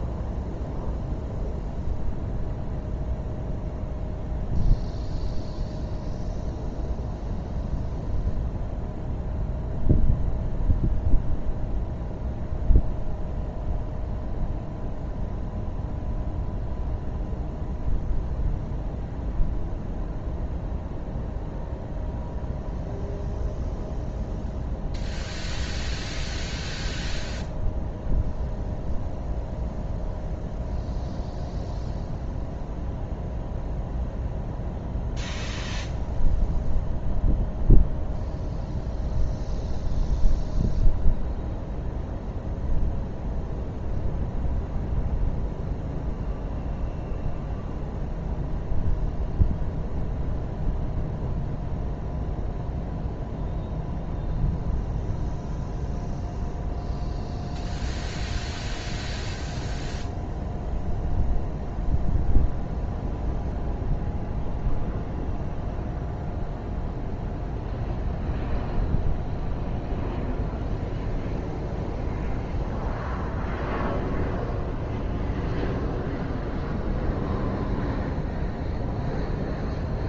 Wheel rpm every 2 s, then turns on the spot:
0, 0, 0, 0, 0, 0, 0, 0, 0, 0, 0, 0, 0, 0, 0, 0, 0, 0, 0, 0, 0, 0, 0, 0, 0, 0, 0, 0, 0, 0, 0, 0, 0, 0, 0, 0, 0, 0, 0, 0.
none